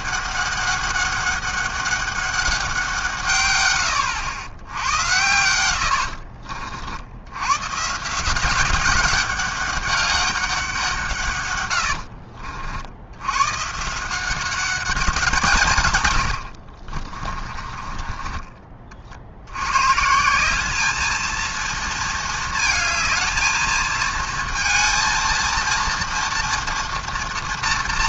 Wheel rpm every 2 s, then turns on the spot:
200, 180, 100, 60, 190, 180, 70, 180, 50, 40, 210, 220, 230, 230.
16-18